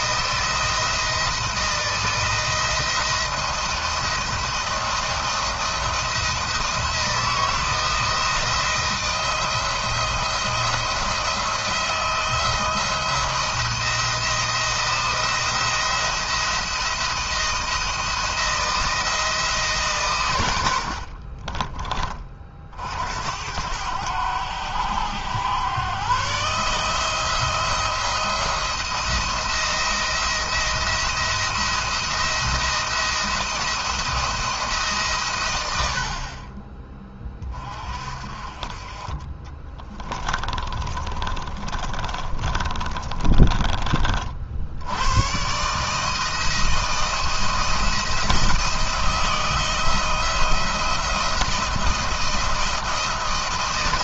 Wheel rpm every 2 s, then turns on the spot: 170, 170, 170, 170, 170, 170, 170, 160, 170, 170, 90, 50, 90, 150, 160, 170, 170, 150, 30, 30, 20, 30, 70, 160, 170, 170, 170.
20-22 40-44